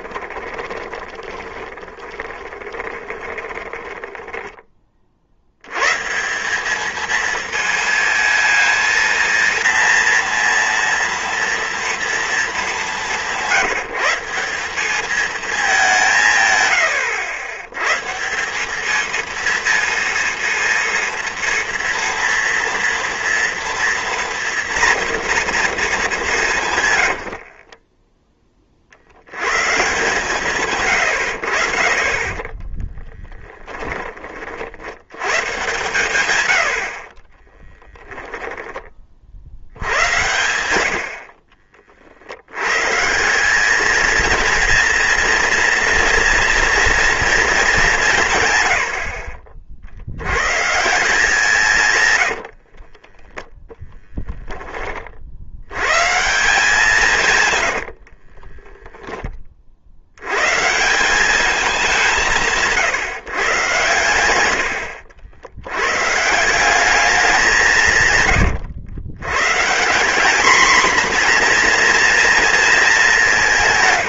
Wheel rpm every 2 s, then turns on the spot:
20, 20, 30, 210, 230, 230, 210, 200, 100, 200, 230, 230, 230, 150, 30, 120, 20, 60, 80, 20, 70, 120, 230, 230, 120, 150, 40, 30, 170, 20, 140, 150, 70, 180, 100, 240, 220.
0-4 32-34 52-54 58-60